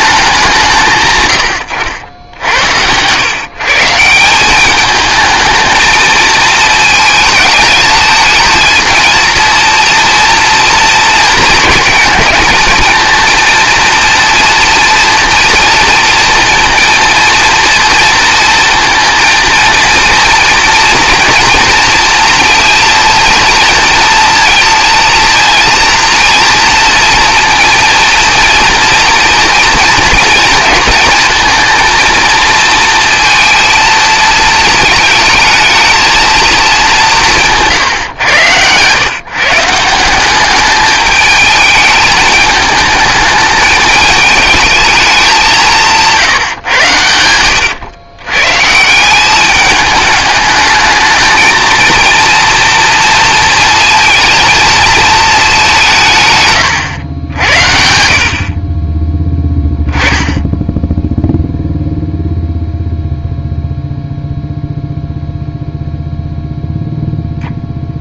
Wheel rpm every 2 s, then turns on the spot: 150, 90, 210, 220, 220, 230, 230, 230, 230, 230, 220, 230, 230, 230, 230, 220, 230, 220, 210, 110, 210, 210, 210, 130, 150, 220, 230, 220, 110, 20, 0, 0, 0, 0.
none